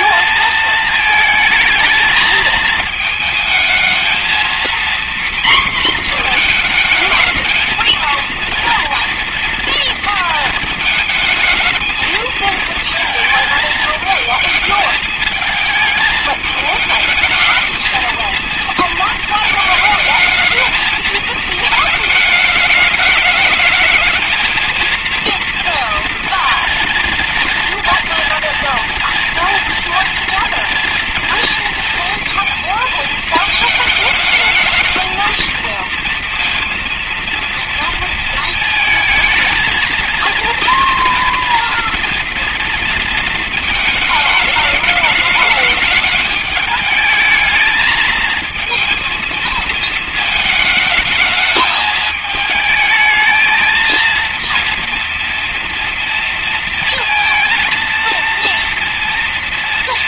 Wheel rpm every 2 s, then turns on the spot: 220, 220, 230, 230, 230, 220, 220, 220, 220, 230, 220, 210, 220, 230, 230, 230, 230, 220, 230, 220, 230, 230, 210, 210, 220, 220, 220, 230, 230, 230.
none